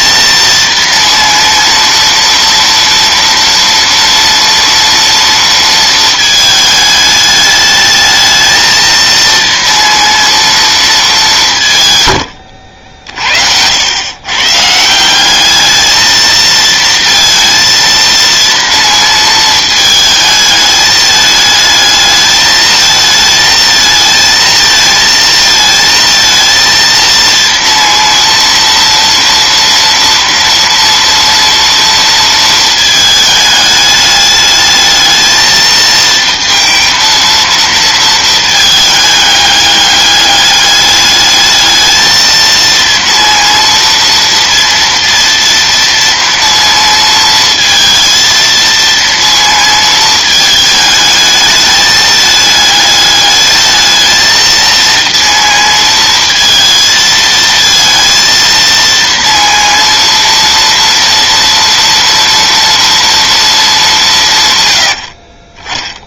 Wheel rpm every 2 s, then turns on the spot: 230, 230, 230, 220, 220, 230, 70, 140, 230, 230, 220, 220, 230, 230, 230, 230, 220, 210, 230, 220, 210, 230, 230, 230, 230, 220, 210, 230, 230, 230, 230, 230, 120.
none